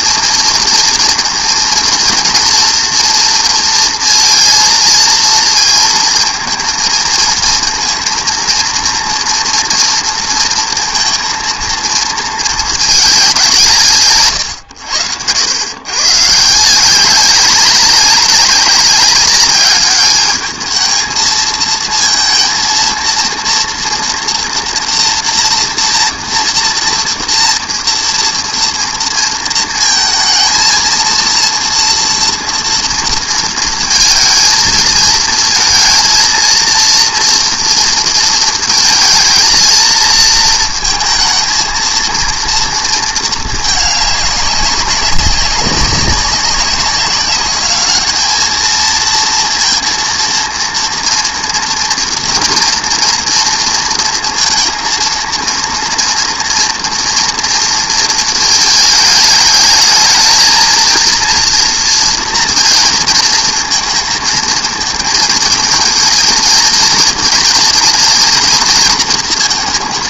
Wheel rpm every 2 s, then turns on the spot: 230, 240, 230, 220, 230, 230, 230, 130, 170, 200, 220, 230, 240, 230, 230, 230, 230, 230, 230, 220, 220, 230, 200, 190, 220, 230, 230, 230, 230, 220, 230, 230, 220, 230, 230.
none